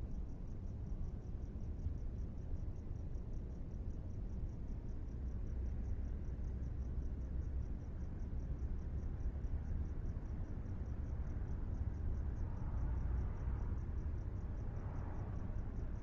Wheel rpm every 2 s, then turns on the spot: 0, 0, 0, 0, 0, 0, 0, 0.
none